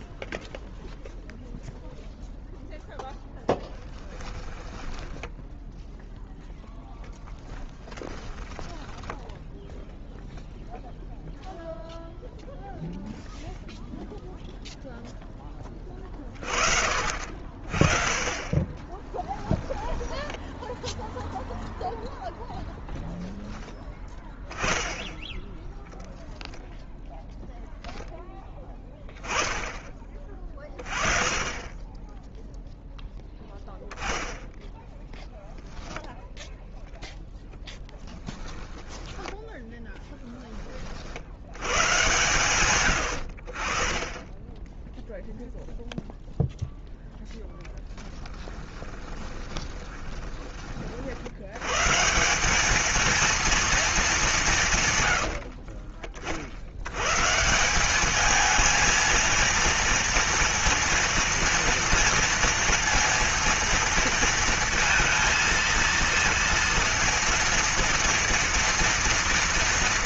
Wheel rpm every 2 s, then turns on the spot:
0, 0, 10, 10, 20, 0, 0, 0, 40, 20, 0, 0, 20, 0, 10, 30, 0, 10, 10, 10, 20, 120, 10, 0, 10, 40, 210, 130, 100, 220, 230, 230, 230, 230, 230.
4-10 18-20 38-40 48-50